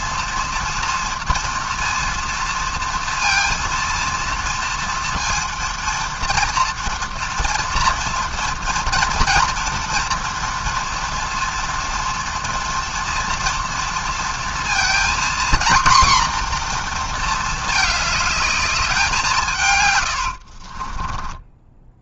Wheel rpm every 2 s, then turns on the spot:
230, 230, 230, 230, 230, 230, 240, 230, 240, 210, 50.
20-22